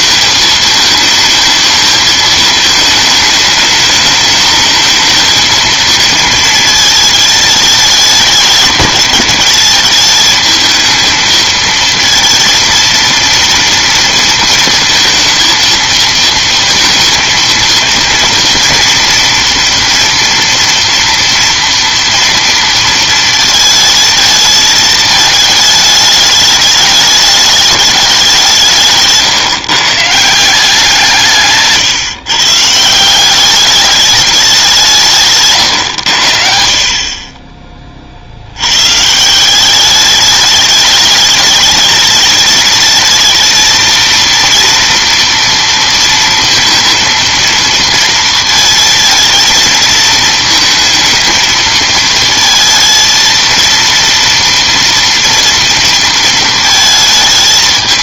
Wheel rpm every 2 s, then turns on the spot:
220, 220, 220, 220, 210, 220, 230, 230, 230, 230, 230, 230, 220, 210, 160, 170, 160, 200, 50, 100, 210, 220, 230, 230, 230, 220, 230, 230, 230.
none